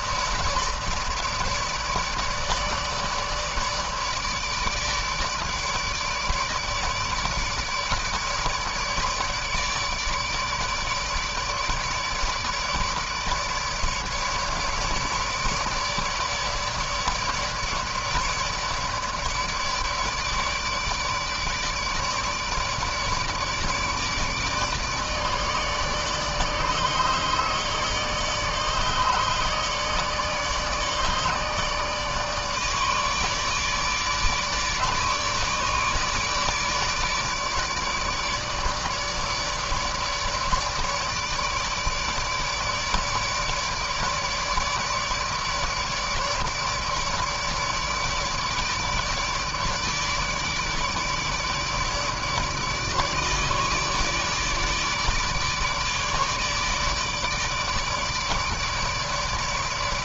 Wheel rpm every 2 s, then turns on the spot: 150, 160, 150, 150, 150, 150, 150, 150, 150, 150, 150, 150, 150, 150, 150, 150, 150, 150, 150, 150, 150, 150, 150, 160, 150, 150, 150, 150, 150, 150.
none